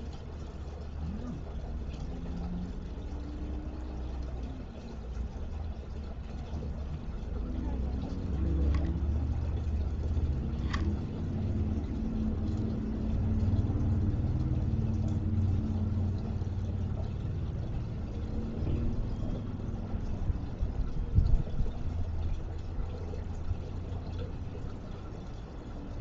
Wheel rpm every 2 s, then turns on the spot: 0, 0, 0, 0, 0, 10, 0, 0, 0, 0, 0, 0, 0.
none